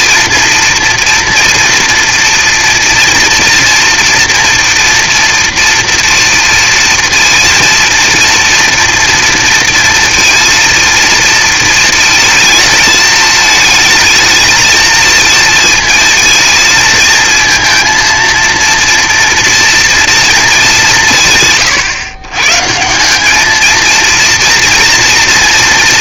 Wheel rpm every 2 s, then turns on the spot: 230, 230, 240, 230, 230, 230, 230, 220, 230, 230, 230, 120, 230.
none